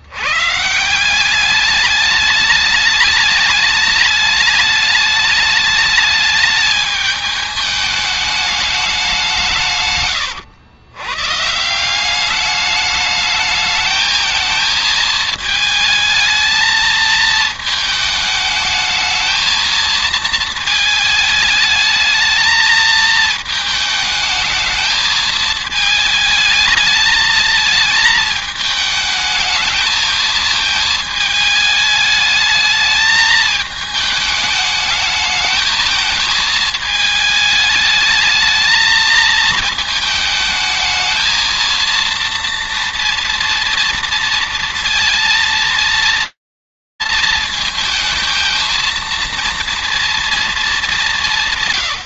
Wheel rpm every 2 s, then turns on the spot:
150, 210, 210, 210, 200, 100, 210, 220, 220, 220, 220, 220, 220, 220, 220, 220, 220, 210, 220, 220, 220, 230, 230, 230, 230, 210.
none